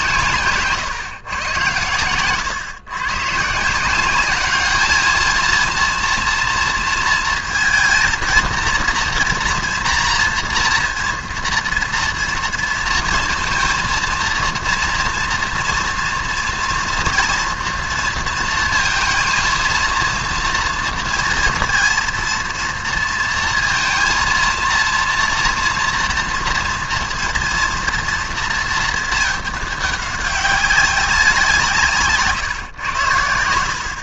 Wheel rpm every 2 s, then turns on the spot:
130, 120, 210, 230, 230, 230, 230, 230, 230, 230, 230, 230, 230, 230, 220, 190, 110.
none